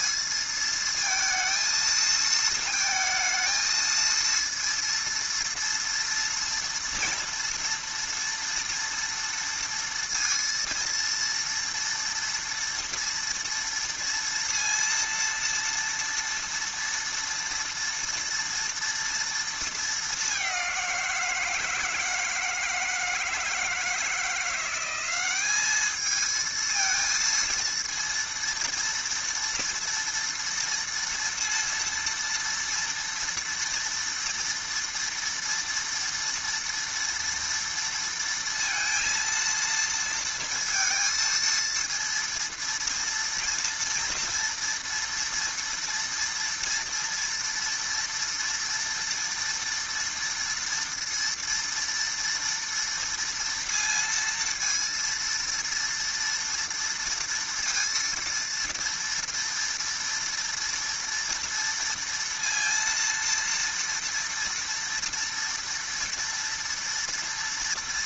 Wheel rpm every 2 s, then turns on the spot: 230, 230, 230, 230, 230, 230, 230, 230, 230, 230, 190, 160, 180, 220, 230, 230, 230, 230, 230, 230, 230, 230, 230, 230, 230, 230, 230, 230, 230, 230, 230, 230, 230, 240.
none